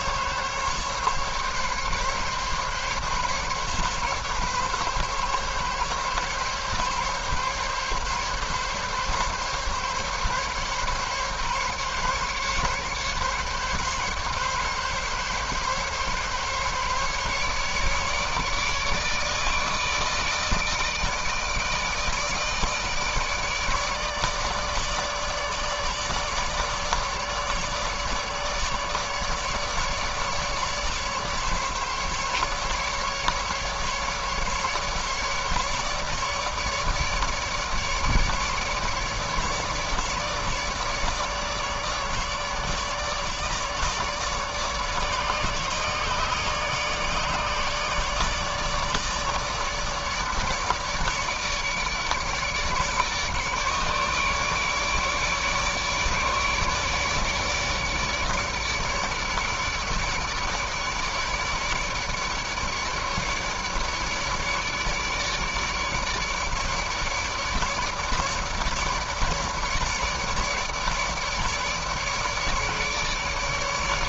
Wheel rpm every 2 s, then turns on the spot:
140, 140, 140, 140, 140, 140, 140, 140, 140, 150, 160, 150, 150, 150, 150, 150, 140, 150, 150, 150, 150, 150, 150, 150, 150, 150, 150, 150, 150, 150, 150, 150, 150, 150, 150, 150, 150.
none